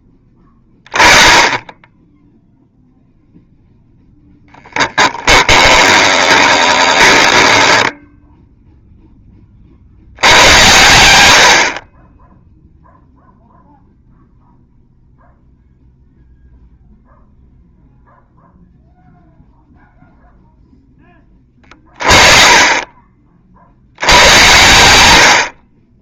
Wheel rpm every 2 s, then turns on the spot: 10, 0, 10, 20, 0, 100, 0, 0, 0, 0, 0, 30, 110.
6-8